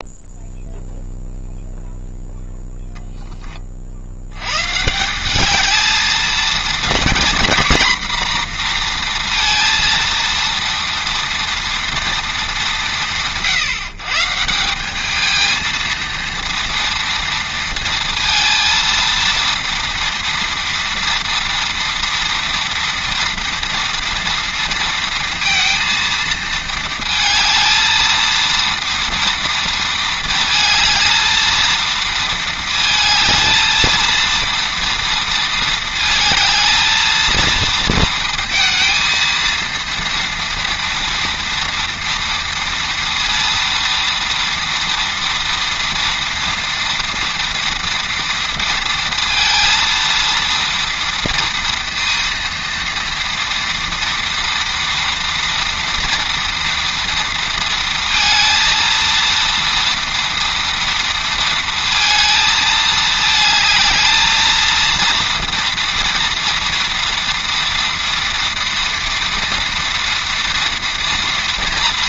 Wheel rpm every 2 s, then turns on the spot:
0, 0, 130, 230, 240, 230, 160, 180, 230, 230, 240, 230, 230, 230, 230, 220, 220, 230, 220, 230, 230, 230, 230, 230, 230, 230, 230, 230, 230, 230, 230, 220, 230, 230, 230, 230.
none